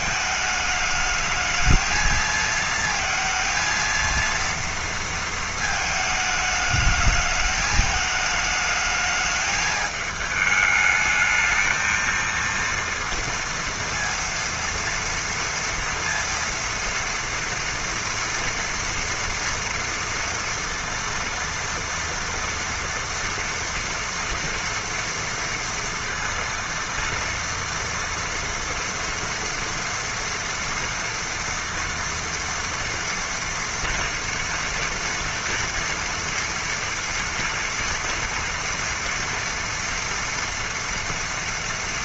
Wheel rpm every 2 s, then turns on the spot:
220, 220, 230, 220, 210, 210, 230, 230, 230, 230, 230, 230, 230, 230, 230, 230, 240, 230, 230, 230, 230.
none